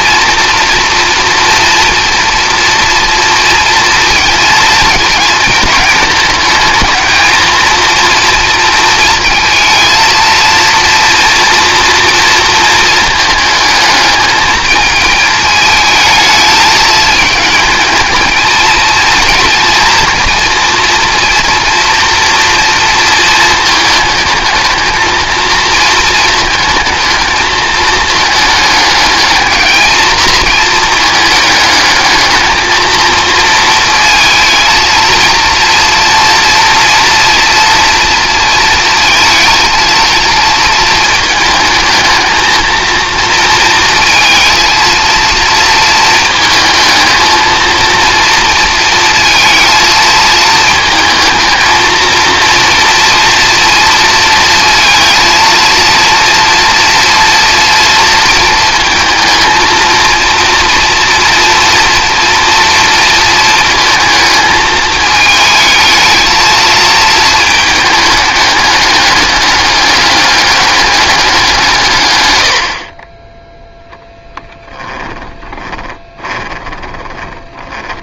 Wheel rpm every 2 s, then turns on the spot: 240, 230, 230, 220, 230, 230, 220, 220, 210, 220, 230, 230, 220, 220, 220, 220, 220, 230, 230, 220, 230, 230, 230, 220, 230, 220, 240, 230, 240, 230, 230, 230, 220, 220, 210, 200, 50, 10, 10.
74-78